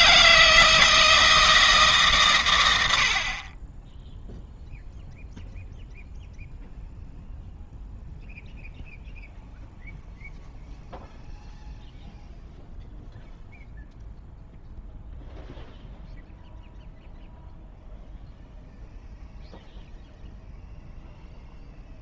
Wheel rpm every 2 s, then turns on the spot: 160, 80, 0, 0, 0, 0, 0, 0, 0, 0, 0.
none